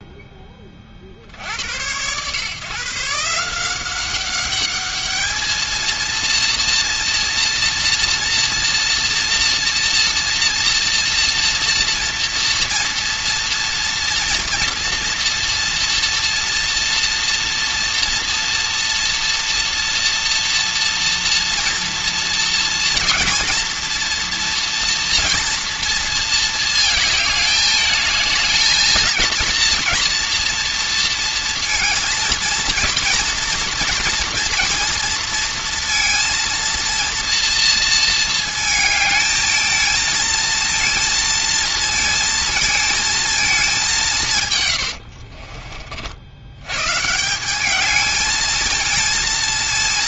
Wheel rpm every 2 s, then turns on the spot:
20, 140, 210, 230, 230, 230, 230, 230, 230, 240, 230, 230, 240, 220, 220, 230, 230, 230, 230, 220, 230, 230, 120, 110, 220.
44-46